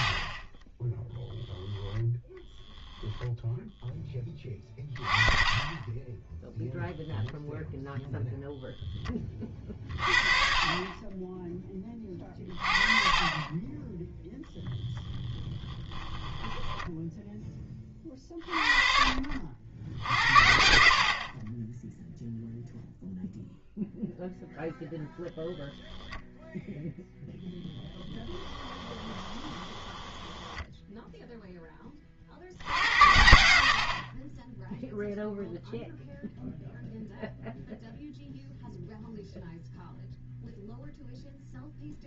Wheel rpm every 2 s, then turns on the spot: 10, 0, 20, 0, 0, 30, 40, 0, 20, 40, 70, 0, 0, 0, 20, 10, 80, 0, 0, 0, 0.
0-2 16-18 28-32